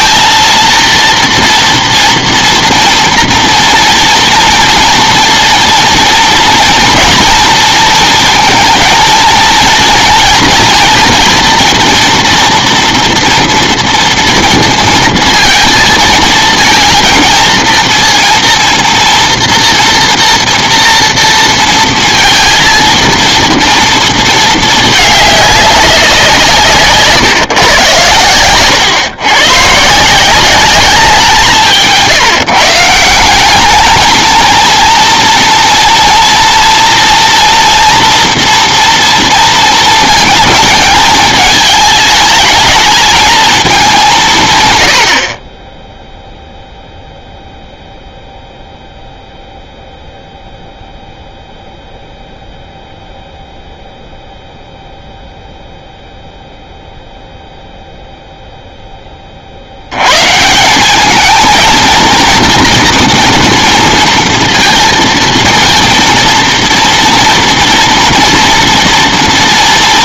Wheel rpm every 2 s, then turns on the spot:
230, 230, 230, 230, 220, 230, 230, 230, 230, 230, 230, 230, 220, 160, 120, 200, 150, 230, 230, 240, 220, 220, 120, 0, 0, 0, 0, 0, 0, 0, 160, 230, 230, 230, 230.
none